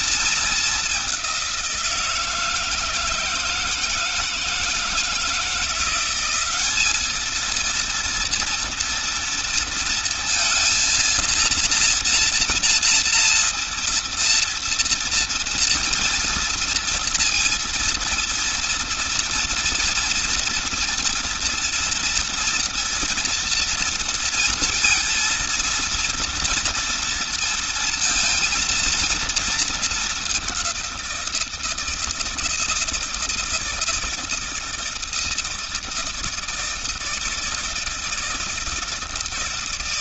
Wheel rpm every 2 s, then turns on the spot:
220, 160, 160, 200, 230, 230, 240, 230, 230, 230, 230, 230, 230, 230, 230, 200, 160, 160, 160, 160.
none